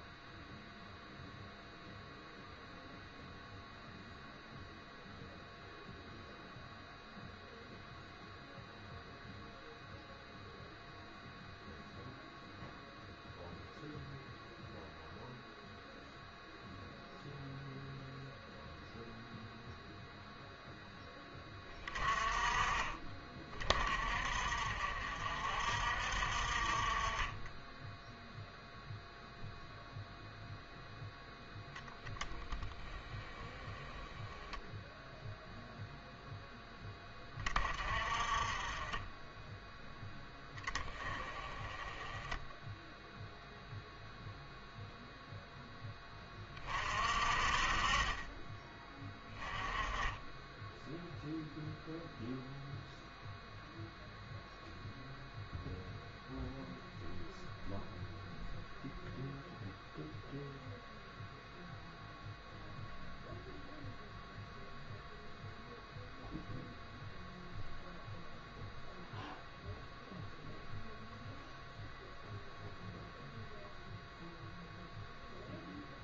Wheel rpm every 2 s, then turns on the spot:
0, 0, 0, 0, 0, 0, 0, 0, 0, 0, 10, 30, 50, 40, 0, 0, 10, 0, 10, 30, 10, 10, 0, 30, 20, 10, 0, 0, 0, 0, 0, 0, 0, 0, 0, 0, 0, 0.
none